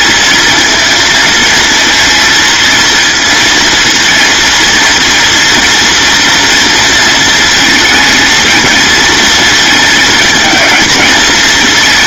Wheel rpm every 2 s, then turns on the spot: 220, 230, 230, 230, 230, 220.
none